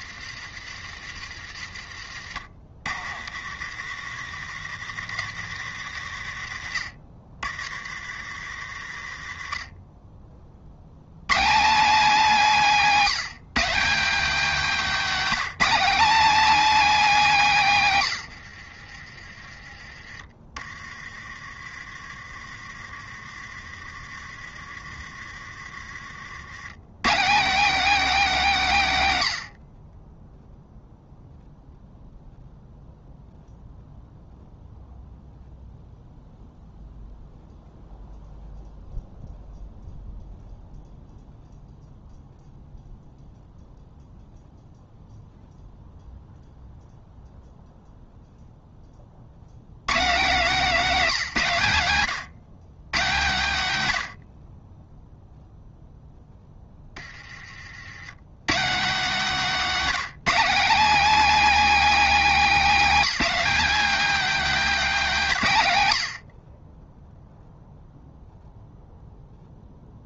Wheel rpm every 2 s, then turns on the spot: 70, 60, 90, 60, 60, 50, 220, 230, 270, 70, 30, 30, 30, 110, 180, 0, 0, 0, 0, 0, 0, 0, 0, 0, 10, 220, 140, 30, 20, 160, 240, 250, 250, 30, 0.
18-20